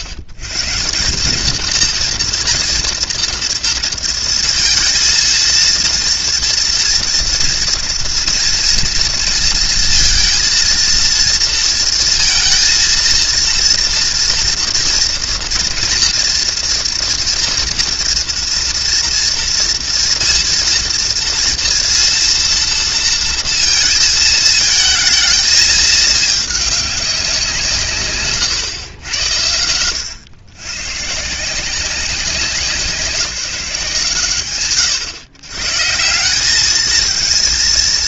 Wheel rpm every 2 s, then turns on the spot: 110, 230, 230, 230, 230, 230, 230, 240, 240, 230, 230, 230, 220, 200, 120, 130, 170, 90, 210.
none